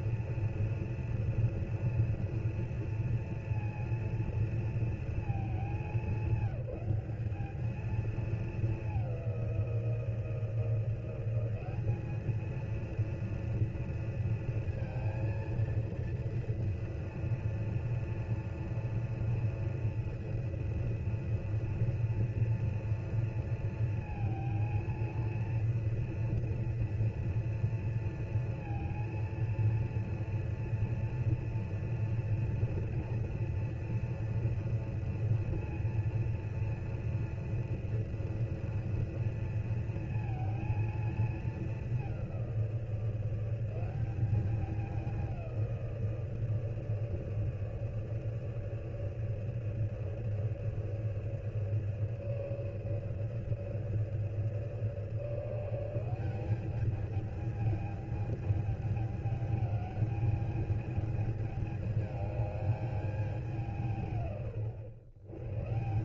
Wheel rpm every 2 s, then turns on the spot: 230, 230, 230, 190, 210, 170, 220, 230, 230, 230, 230, 230, 230, 230, 230, 240, 240, 240, 230, 230, 230, 180, 200, 160, 150, 150, 150, 150, 190, 210, 220, 210, 120.
none